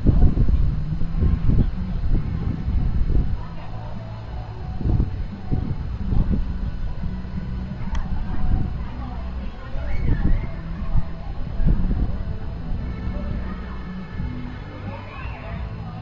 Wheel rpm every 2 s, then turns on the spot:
0, 0, 0, 0, 0, 0, 0, 0.
none